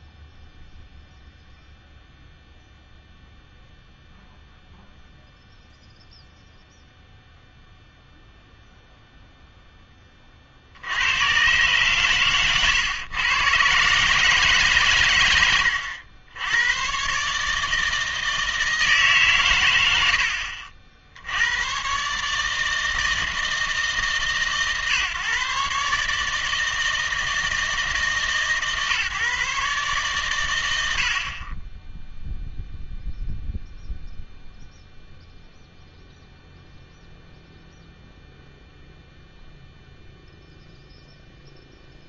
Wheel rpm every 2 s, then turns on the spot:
0, 0, 0, 0, 0, 70, 120, 130, 110, 160, 60, 150, 140, 160, 140, 80, 0, 0, 0, 0, 0.
none